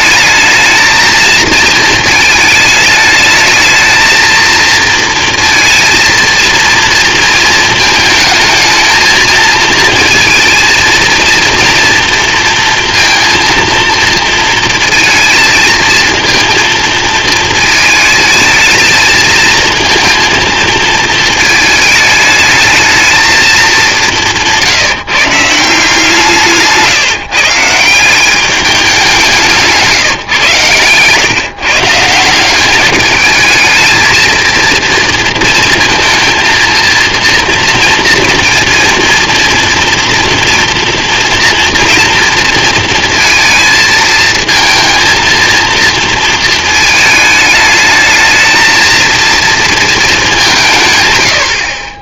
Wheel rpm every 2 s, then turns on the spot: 220, 220, 230, 230, 220, 230, 230, 230, 230, 220, 220, 220, 150, 150, 190, 130, 210, 230, 230, 230, 230, 230, 230, 220, 230, 100.
none